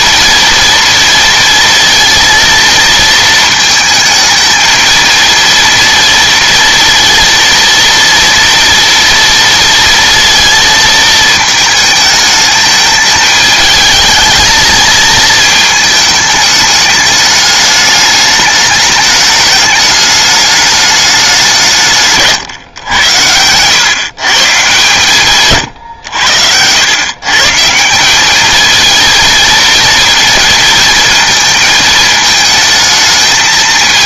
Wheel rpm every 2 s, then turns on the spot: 230, 230, 230, 230, 240, 220, 210, 220, 210, 210, 210, 110, 140, 110, 230, 230, 220.
none